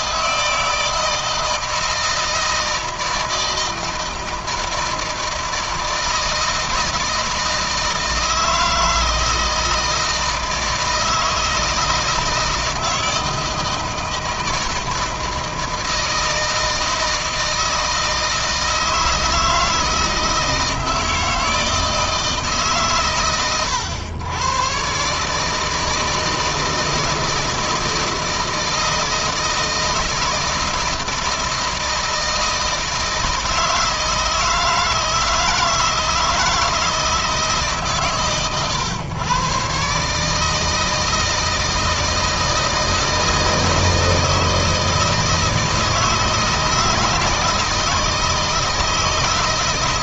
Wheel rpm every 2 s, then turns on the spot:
160, 160, 160, 160, 160, 160, 160, 160, 160, 160, 160, 140, 130, 160, 160, 160, 160, 160, 160, 120, 160, 160, 160, 160, 160.
none